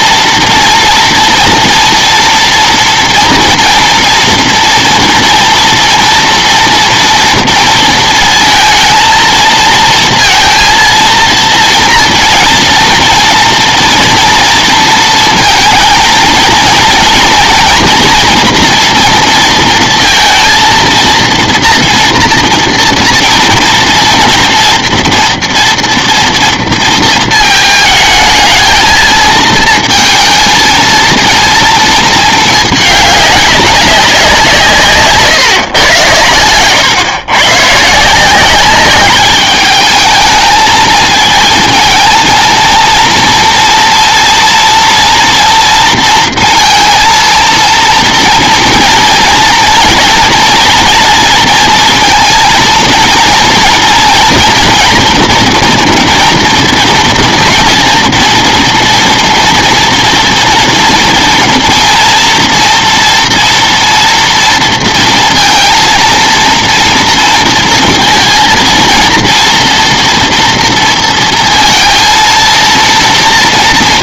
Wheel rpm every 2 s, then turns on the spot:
230, 230, 230, 230, 220, 230, 230, 230, 230, 230, 230, 230, 230, 230, 220, 230, 210, 170, 110, 190, 220, 230, 230, 230, 230, 230, 230, 240, 230, 230, 230, 230, 230, 230, 230, 230, 230.
none